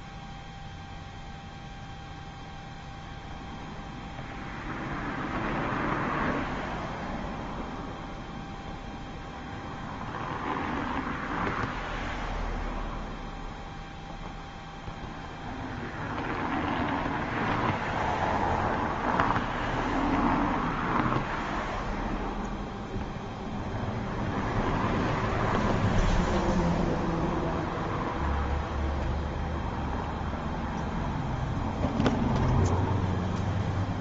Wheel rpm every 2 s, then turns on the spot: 0, 0, 0, 0, 0, 0, 0, 0, 0, 0, 0, 0, 0, 0, 0, 0, 0.
none